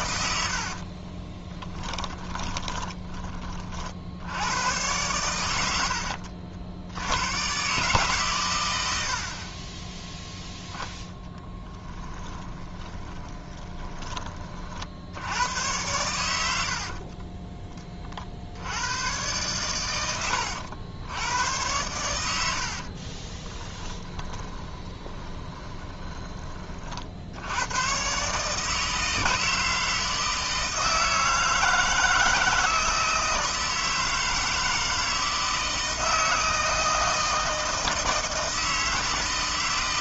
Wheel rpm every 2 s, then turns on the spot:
60, 20, 90, 70, 100, 0, 20, 40, 70, 70, 90, 60, 20, 30, 150, 160, 160, 160, 160, 160.
2-4 12-14 24-26